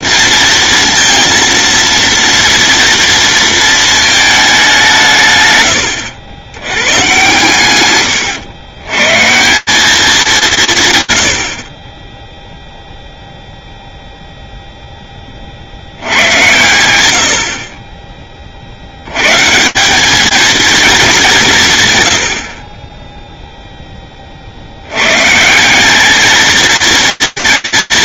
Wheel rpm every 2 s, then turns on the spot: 230, 240, 180, 110, 130, 150, 0, 10, 90, 100, 210, 20, 120, 230.
none